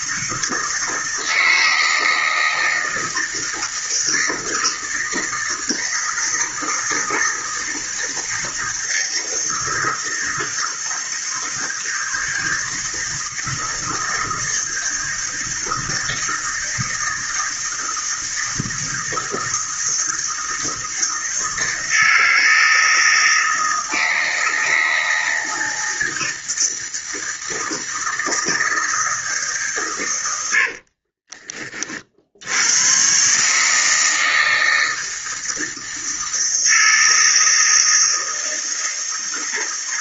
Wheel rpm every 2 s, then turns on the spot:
160, 160, 160, 160, 160, 160, 160, 160, 160, 160, 160, 160, 160, 160, 160, 40, 130, 160, 160, 160.
30-32